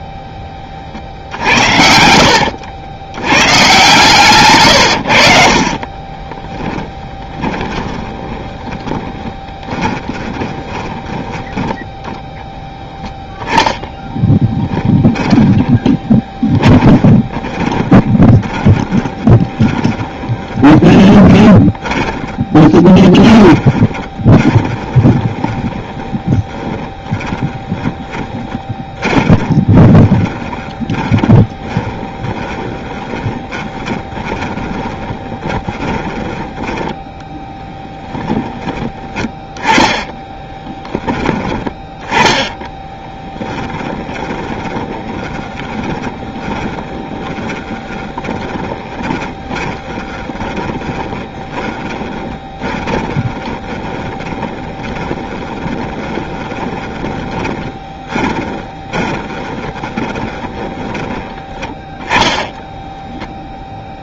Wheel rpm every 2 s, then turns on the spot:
30, 80, 120, 10, 20, 20, 0, 10, 10, 20, 20, 20, 20, 20, 20, 20, 20, 20, 10, 10, 10, 20, 20, 10, 30, 20, 20, 20, 20, 20, 20, 10.
4-12 14-36 42-64